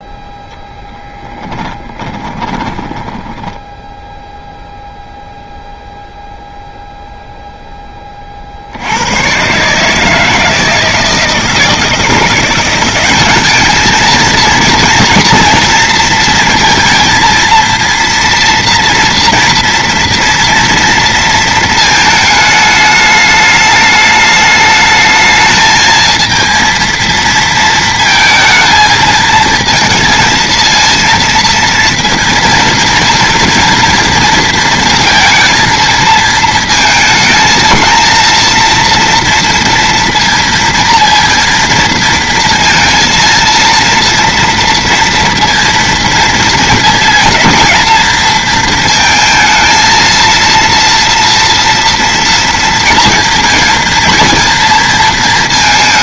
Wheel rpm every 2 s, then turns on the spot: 0, 20, 0, 0, 60, 160, 180, 230, 230, 230, 230, 220, 210, 220, 230, 230, 230, 230, 220, 220, 230, 230, 230, 230, 230, 230, 230, 230.
2-4